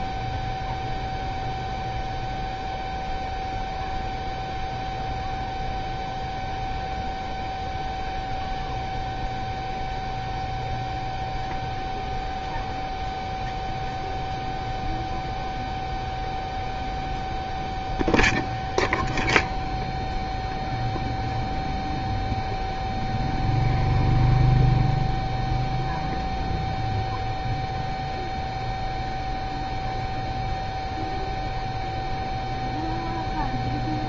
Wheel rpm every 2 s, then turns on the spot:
0, 0, 0, 0, 0, 0, 0, 0, 0, 0, 0, 0, 0, 0, 0, 0, 0.
none